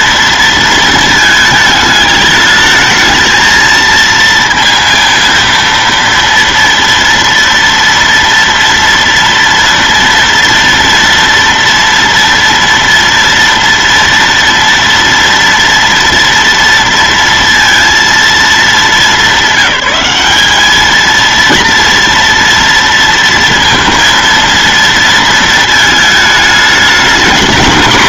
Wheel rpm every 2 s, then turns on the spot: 220, 220, 230, 230, 230, 230, 230, 230, 230, 220, 220, 230, 230, 220.
none